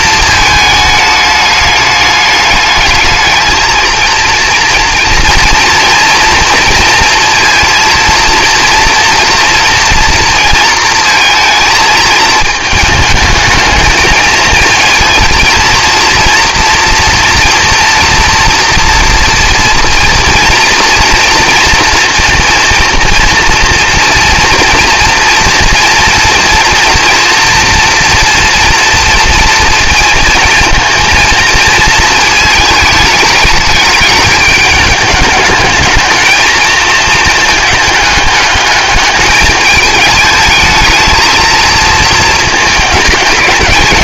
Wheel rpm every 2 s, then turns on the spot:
220, 210, 230, 230, 230, 230, 220, 220, 230, 230, 230, 230, 240, 240, 240, 230, 220, 210, 220, 210, 220, 220.
none